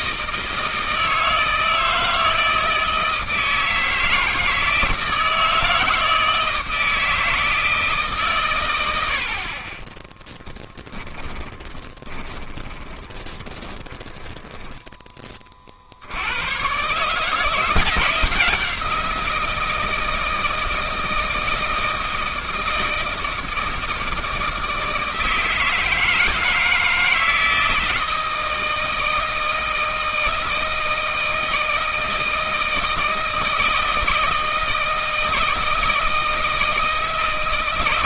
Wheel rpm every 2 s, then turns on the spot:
160, 160, 160, 160, 120, 20, 30, 10, 110, 170, 160, 160, 160, 160, 160, 160, 160, 160, 160.
10-14